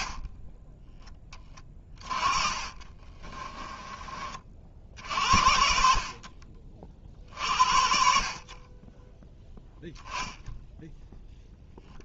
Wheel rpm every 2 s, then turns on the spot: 30, 20, 60, 40, 20, 0.
2-4